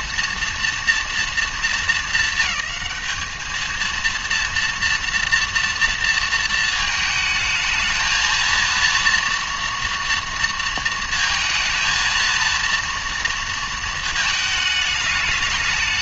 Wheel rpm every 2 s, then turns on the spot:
230, 220, 230, 220, 230, 230, 230, 210.
none